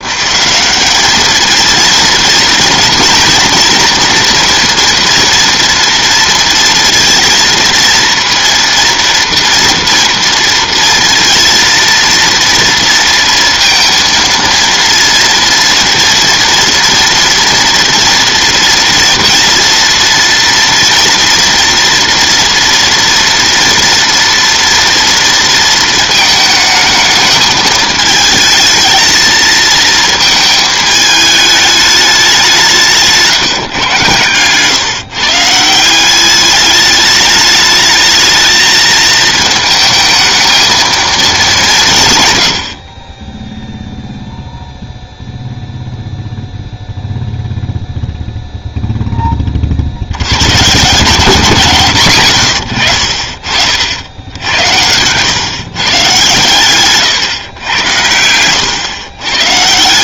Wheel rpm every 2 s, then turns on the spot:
200, 230, 230, 230, 230, 230, 230, 230, 230, 230, 230, 230, 230, 220, 220, 220, 170, 140, 210, 220, 220, 50, 0, 0, 0, 150, 100, 100, 120, 110.
56-58